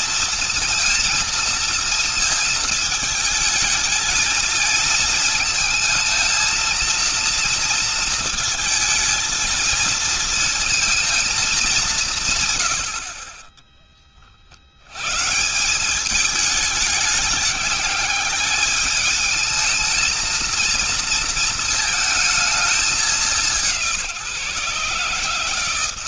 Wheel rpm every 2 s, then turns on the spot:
230, 230, 220, 220, 230, 220, 130, 70, 210, 210, 230, 210, 160.
none